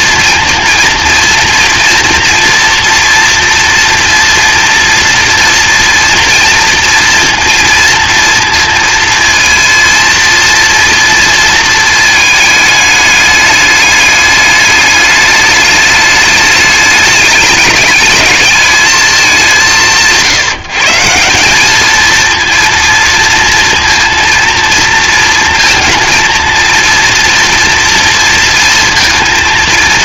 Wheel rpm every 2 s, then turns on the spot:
230, 240, 230, 240, 230, 230, 220, 210, 210, 210, 160, 230, 230, 230, 230.
none